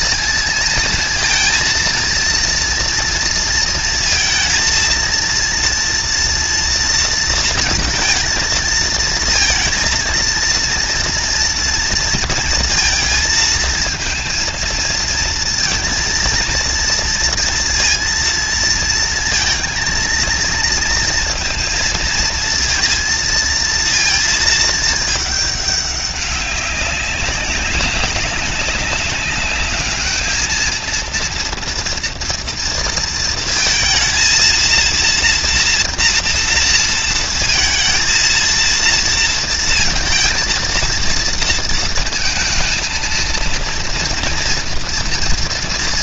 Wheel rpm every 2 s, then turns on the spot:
230, 230, 230, 230, 230, 230, 230, 230, 230, 230, 230, 230, 220, 190, 190, 230, 230, 230, 230, 230, 230, 220, 230.
none